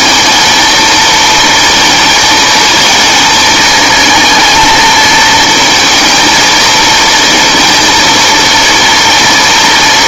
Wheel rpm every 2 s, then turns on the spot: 220, 220, 230, 220, 230.
none